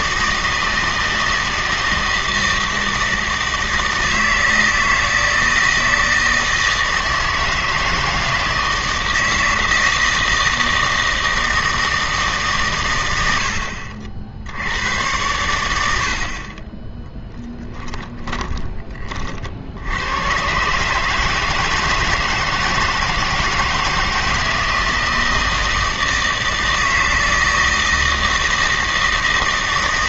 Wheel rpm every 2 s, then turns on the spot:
160, 160, 160, 160, 160, 160, 120, 80, 20, 20, 130, 160, 160, 160, 160.
none